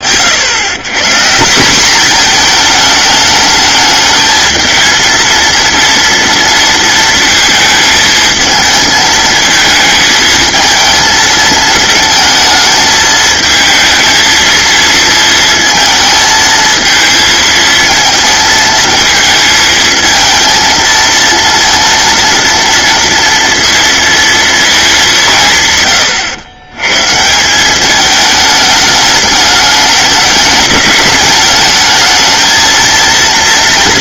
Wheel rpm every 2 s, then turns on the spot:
60, 190, 220, 230, 230, 220, 220, 220, 230, 220, 220, 230, 230, 150, 180, 210, 210.
none